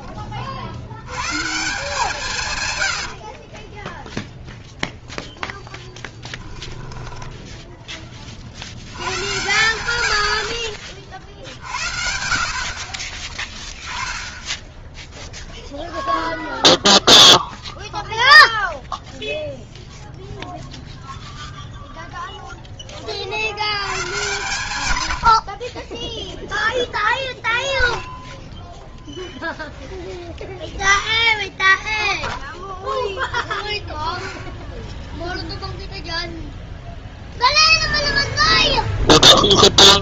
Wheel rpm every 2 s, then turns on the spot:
30, 140, 0, 10, 60, 60, 50, 0, 0, 0, 0, 0, 120, 10, 10, 0, 0, 0, 0, 0.
6-8 28-30